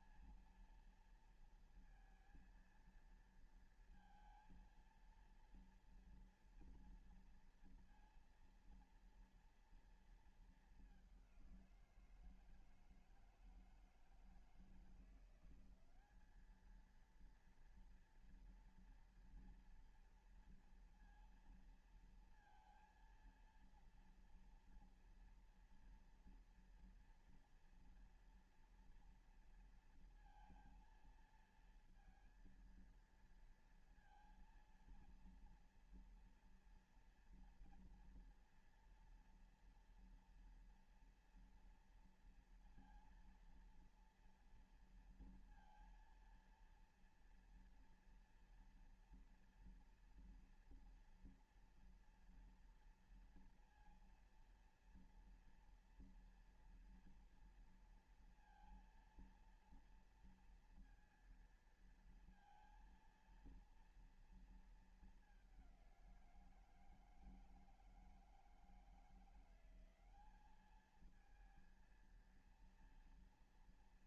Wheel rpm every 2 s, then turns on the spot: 230, 230, 230, 230, 230, 210, 160, 170, 220, 230, 230, 230, 230, 230, 230, 230, 230, 230, 230, 230, 230, 230, 230, 230, 240, 240, 230, 230, 230, 230, 230, 230, 220, 170, 160, 210, 230.
none